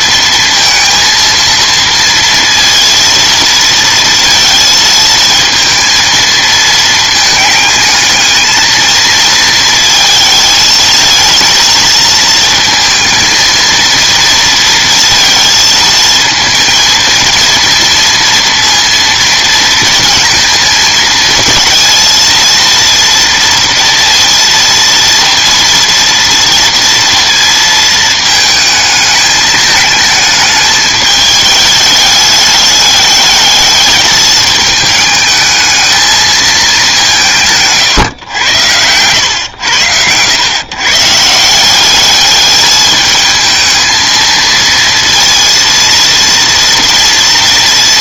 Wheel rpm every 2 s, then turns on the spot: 230, 230, 230, 220, 220, 220, 230, 230, 230, 230, 220, 230, 230, 230, 220, 220, 210, 220, 220, 100, 120, 220, 230, 230.
38-40